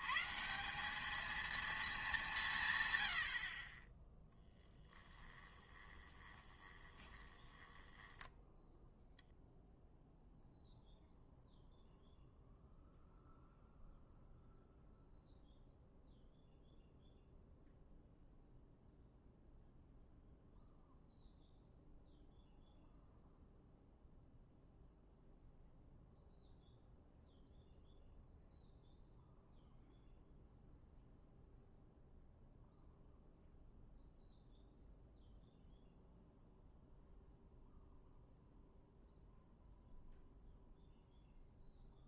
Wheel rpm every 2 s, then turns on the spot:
170, 150, 10, 20, 0, 0, 0, 0, 0, 0, 0, 0, 0, 0, 0, 0, 0, 0, 0, 0, 0.
4-8